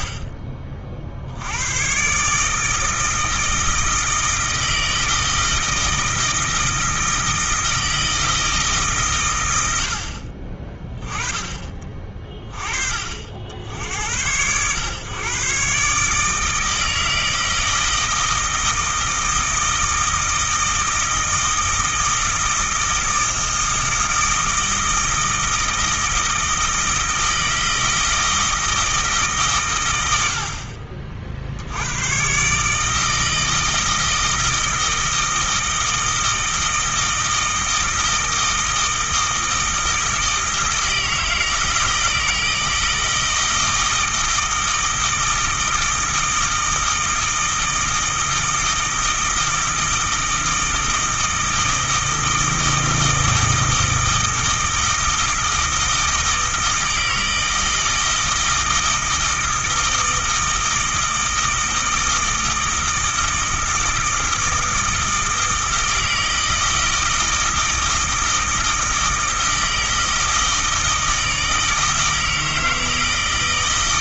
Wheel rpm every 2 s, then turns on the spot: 40, 160, 160, 160, 160, 30, 30, 110, 160, 160, 160, 160, 160, 160, 160, 60, 150, 160, 160, 160, 160, 160, 160, 160, 160, 160, 160, 160, 160, 160, 160, 160, 160, 160, 160, 160, 160.
none